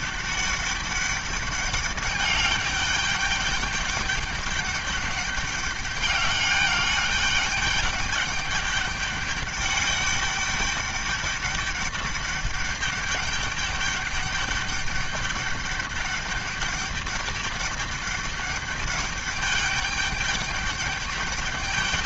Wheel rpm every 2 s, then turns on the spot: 200, 200, 200, 200, 200, 200, 200, 200, 200, 200, 200.
none